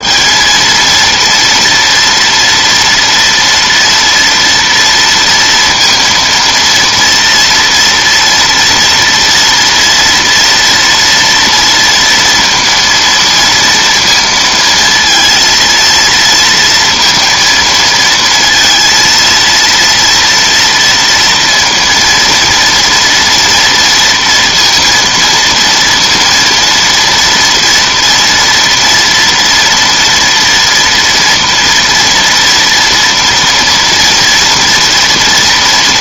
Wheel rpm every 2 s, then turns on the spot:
220, 230, 240, 230, 230, 230, 230, 230, 230, 230, 230, 230, 230, 230, 240, 230, 230, 230.
none